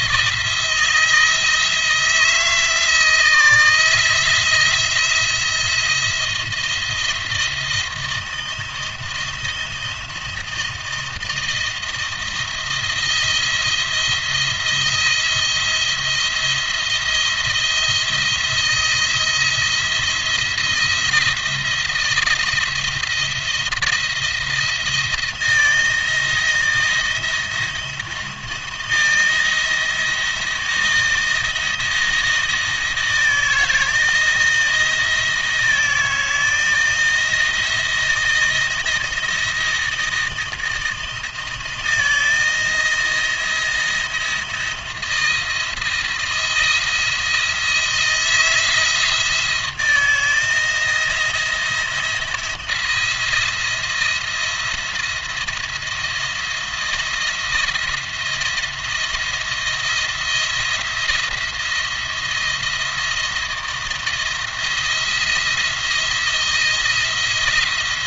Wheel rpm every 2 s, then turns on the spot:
170, 160, 170, 170, 170, 160, 160, 170, 170, 170, 170, 170, 170, 160, 170, 170, 160, 170, 160, 170, 160, 170, 160, 160, 160, 160, 170, 170, 170, 170, 170, 170, 170, 160.
none